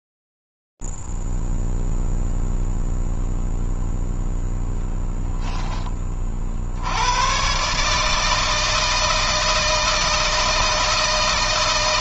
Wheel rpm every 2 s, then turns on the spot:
0, 0, 0, 30, 150, 160.
none